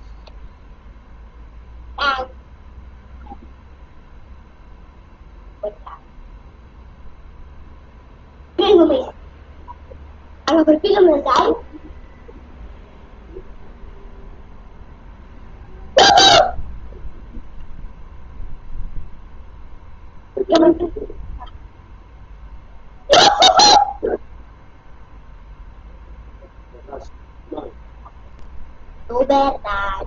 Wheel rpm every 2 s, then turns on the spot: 0, 0, 0, 0, 0, 0, 0, 0, 0, 0, 0, 0, 0, 0, 0.
none